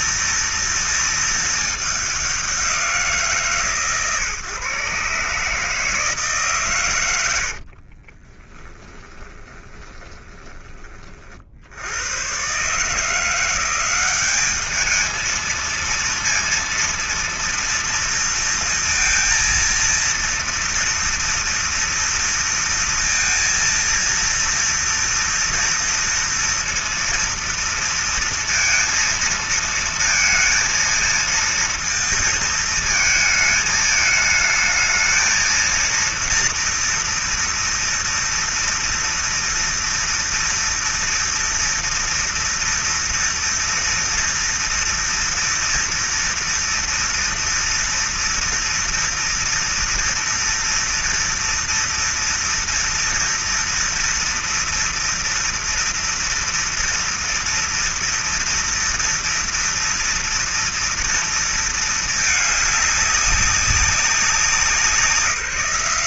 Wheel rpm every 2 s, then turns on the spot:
230, 200, 140, 150, 30, 20, 100, 190, 230, 230, 230, 230, 230, 230, 230, 230, 230, 220, 230, 230, 230, 240, 230, 230, 230, 230, 240, 230, 230, 230, 230, 220, 190.
8-12